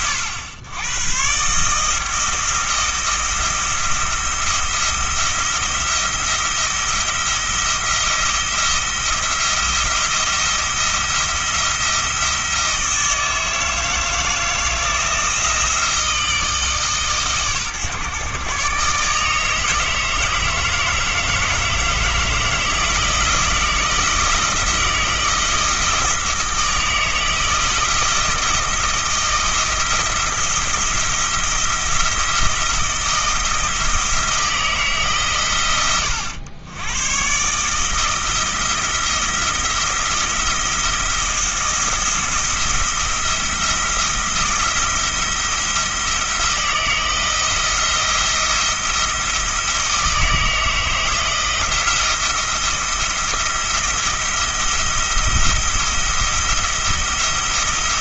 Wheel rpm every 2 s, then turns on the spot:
100, 170, 170, 170, 170, 170, 160, 160, 150, 140, 160, 160, 160, 160, 160, 170, 160, 140, 100, 170, 170, 170, 170, 160, 170, 160, 170, 170, 170.
none